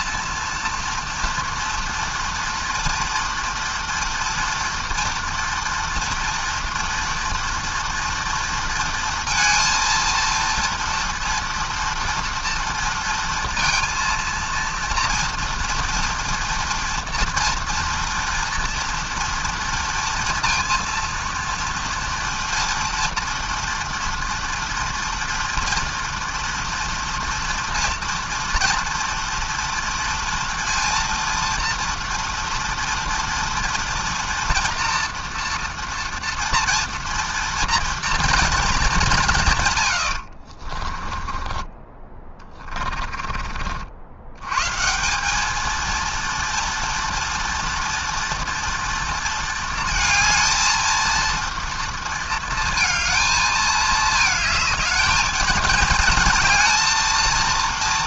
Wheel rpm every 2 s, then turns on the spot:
230, 230, 230, 240, 230, 230, 230, 230, 230, 230, 230, 230, 230, 230, 230, 230, 230, 230, 230, 210, 30, 30, 150, 230, 230, 230, 230, 220, 230.
40-44